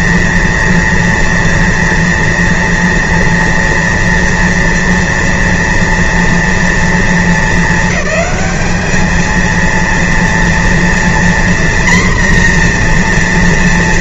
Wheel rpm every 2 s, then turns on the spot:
230, 230, 230, 230, 210, 230, 240.
none